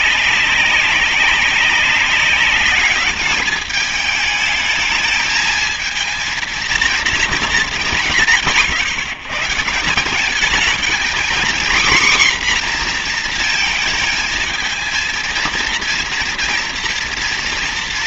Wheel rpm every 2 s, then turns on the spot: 190, 200, 220, 230, 150, 210, 260, 230, 230.
none